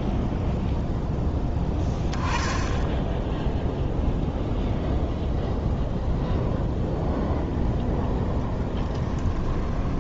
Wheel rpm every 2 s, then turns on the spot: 0, 10, 0, 0, 10.
8-10